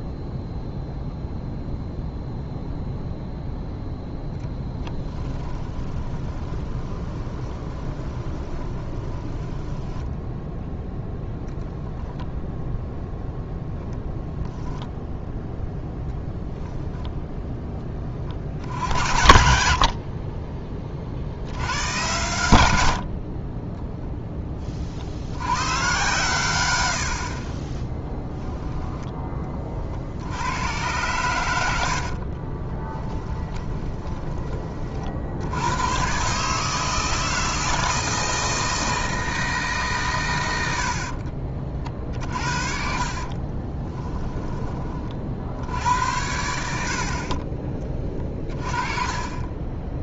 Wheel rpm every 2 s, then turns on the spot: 0, 0, 10, 20, 20, 0, 0, 0, 10, 60, 40, 80, 40, 80, 10, 110, 20, 30, 150, 160, 70, 50, 20, 70, 30.
4-10 16-18 32-34 40-44